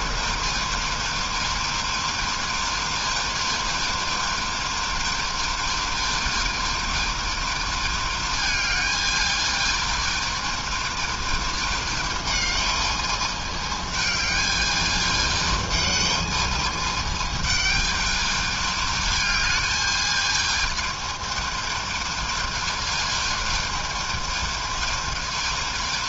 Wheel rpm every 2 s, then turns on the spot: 220, 220, 220, 220, 220, 220, 220, 210, 210, 210, 220, 220, 220.
none